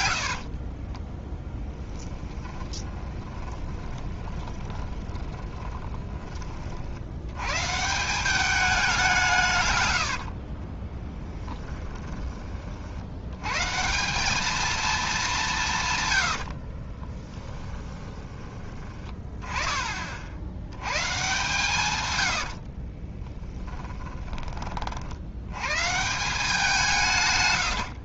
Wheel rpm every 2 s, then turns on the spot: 10, 20, 20, 60, 200, 30, 50, 220, 50, 20, 100, 50, 40, 180.
0-6 10-12 16-18 22-24